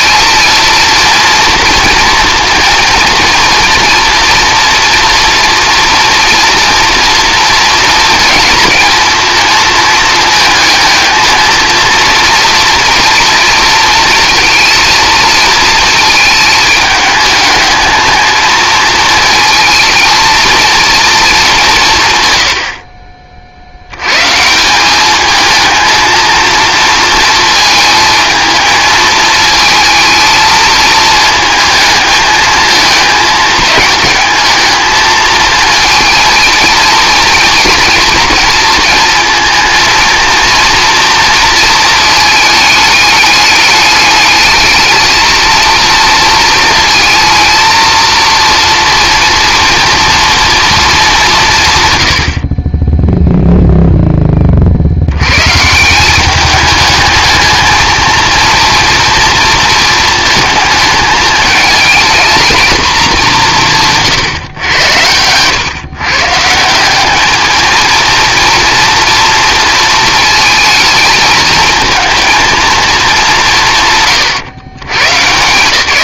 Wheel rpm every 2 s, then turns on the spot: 230, 230, 230, 230, 230, 220, 230, 230, 210, 220, 220, 30, 190, 230, 220, 220, 220, 220, 230, 230, 230, 210, 220, 230, 230, 210, 10, 60, 210, 230, 220, 220, 110, 180, 230, 220, 230, 120.
none